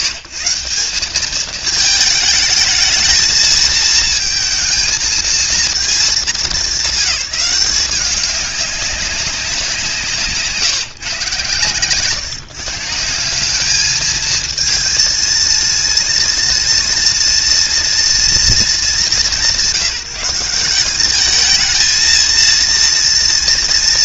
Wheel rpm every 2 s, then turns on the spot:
140, 220, 230, 210, 200, 150, 150, 230, 230, 220, 180, 230.
none